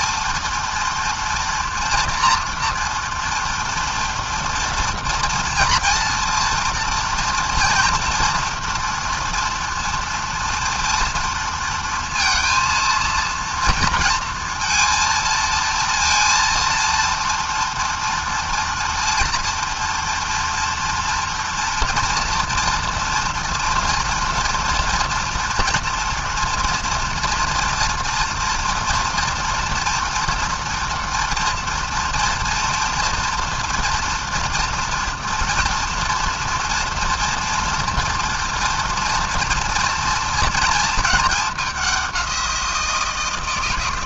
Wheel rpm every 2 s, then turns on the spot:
230, 230, 230, 230, 230, 230, 230, 230, 230, 230, 230, 230, 230, 230, 240, 230, 230, 240, 230, 230, 210, 170.
none